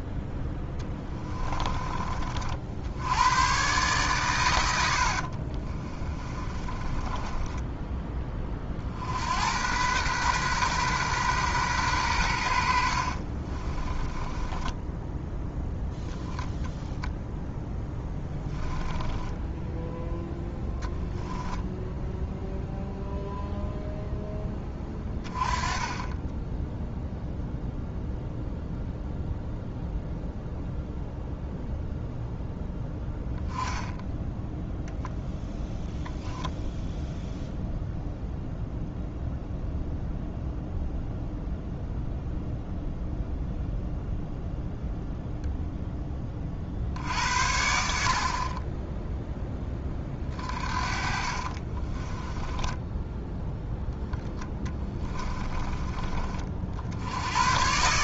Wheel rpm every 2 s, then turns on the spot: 10, 60, 90, 20, 40, 130, 70, 10, 0, 10, 10, 0, 10, 0, 0, 0, 0, 0, 0, 0, 0, 0, 0, 40, 30, 40, 10, 10, 60.
0-2 6-8 12-16 18-20 50-56